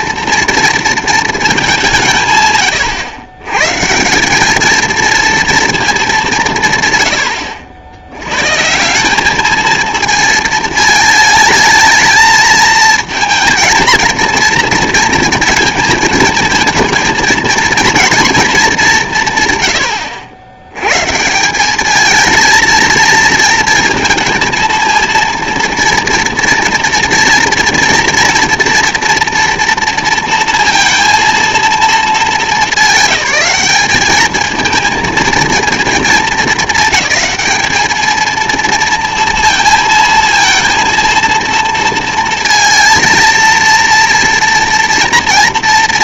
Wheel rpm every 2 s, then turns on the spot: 230, 120, 220, 140, 160, 220, 230, 230, 220, 210, 100, 230, 230, 230, 240, 230, 200, 220, 210, 230, 230, 230, 240.
none